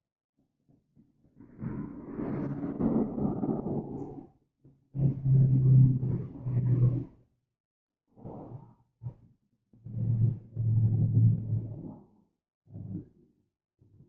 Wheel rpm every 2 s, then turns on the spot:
0, 0, 0, 0, 0, 0, 0.
none